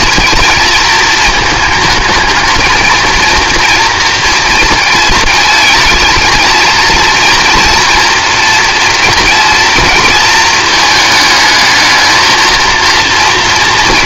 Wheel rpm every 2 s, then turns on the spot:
230, 230, 230, 230, 240, 220, 230.
none